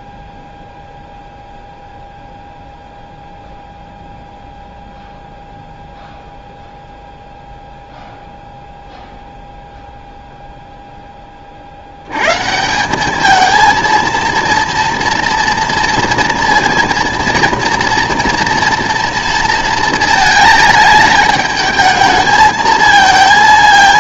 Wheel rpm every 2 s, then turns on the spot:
0, 0, 0, 0, 0, 0, 160, 230, 230, 230, 220, 220.
none